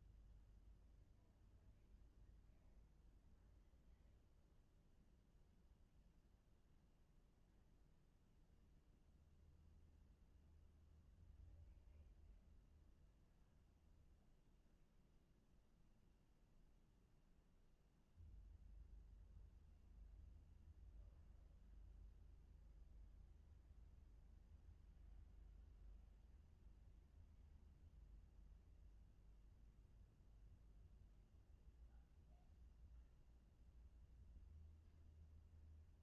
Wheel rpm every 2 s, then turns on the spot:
0, 0, 0, 0, 0, 0, 0, 0, 0, 0, 0, 0, 0, 0, 0, 0, 0, 0.
none